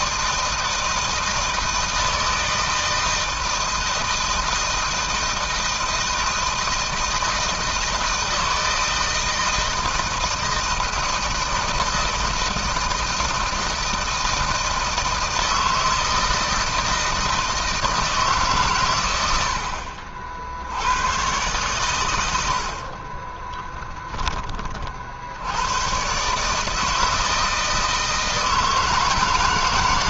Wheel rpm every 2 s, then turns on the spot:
160, 160, 160, 160, 160, 160, 160, 160, 160, 120, 100, 50, 50, 160, 150.
22-24